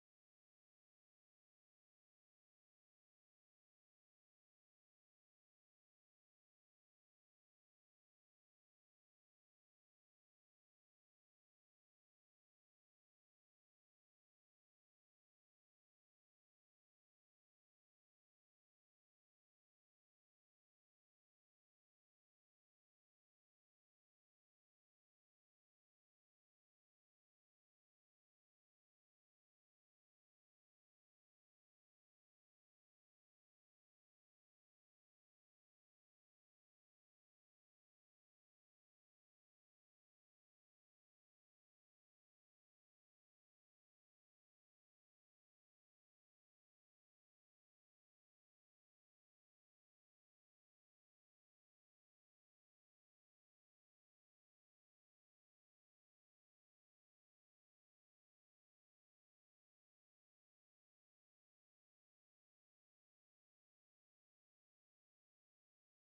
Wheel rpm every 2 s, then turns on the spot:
0, 0, 0, 0, 0, 20, 20, 20, 10, 80, 20, 10, 0, 0, 0, 0, 0, 0, 0, 0, 0, 0, 0, 0, 0, 0, 0, 0, 0, 0, 0, 0, 0.
12-16 20-24